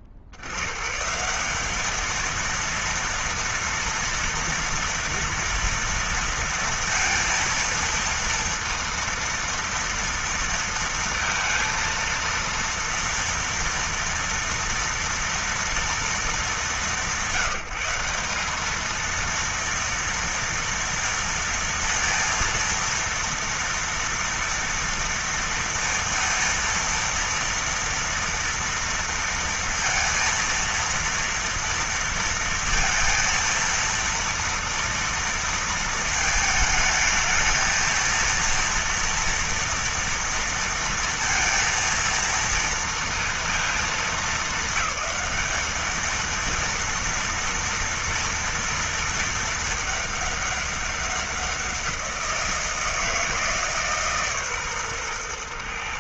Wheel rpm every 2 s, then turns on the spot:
50, 230, 240, 230, 230, 230, 230, 230, 190, 200, 230, 230, 230, 230, 230, 230, 230, 230, 220, 230, 230, 230, 220, 220, 230, 200, 170, 140.
none